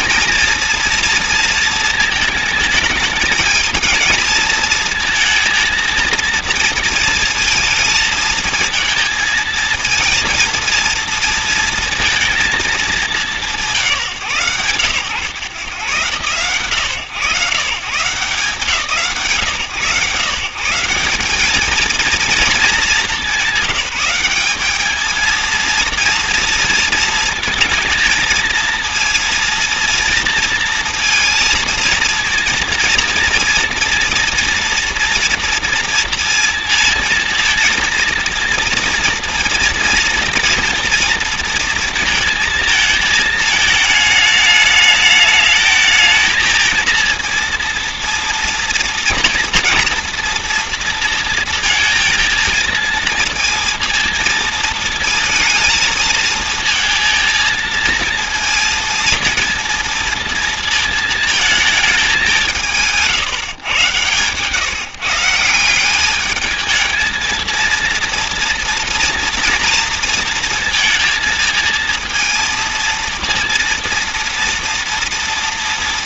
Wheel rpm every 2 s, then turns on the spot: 230, 220, 220, 230, 220, 230, 220, 100, 100, 150, 160, 220, 200, 220, 220, 230, 230, 230, 230, 230, 230, 230, 210, 230, 230, 230, 220, 230, 220, 230, 230, 180, 140, 210, 230, 230, 220, 240.
none